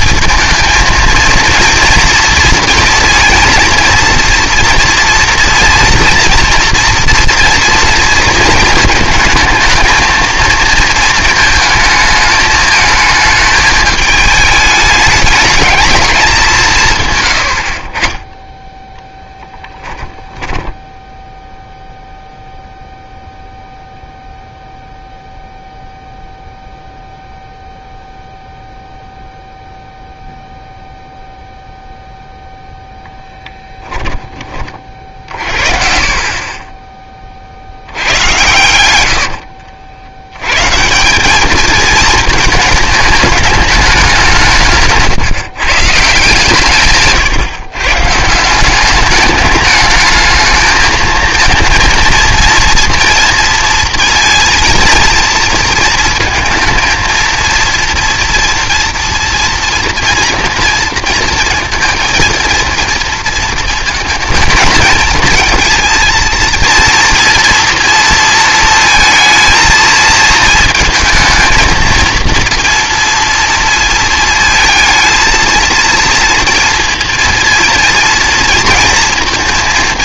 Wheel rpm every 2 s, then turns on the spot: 230, 230, 230, 230, 220, 230, 220, 210, 160, 10, 10, 0, 0, 0, 0, 0, 0, 30, 20, 100, 130, 220, 160, 140, 190, 220, 230, 230, 230, 230, 230, 230, 220, 230, 230, 220, 230, 220, 230, 230.
18-22